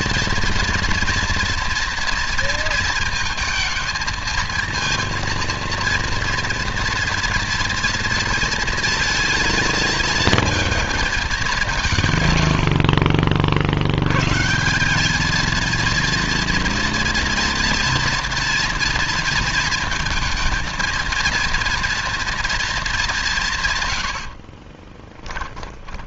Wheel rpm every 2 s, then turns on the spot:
230, 230, 230, 230, 230, 220, 60, 180, 230, 230, 220, 210, 30.
24-26